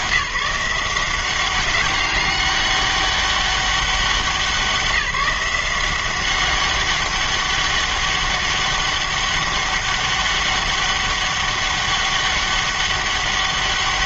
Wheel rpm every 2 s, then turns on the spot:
170, 200, 190, 190, 200, 200, 200.
none